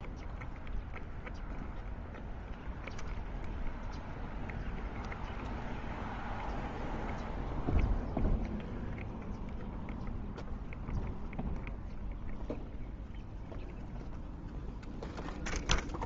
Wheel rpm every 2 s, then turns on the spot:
0, 0, 0, 0, 0, 0, 0, 0.
none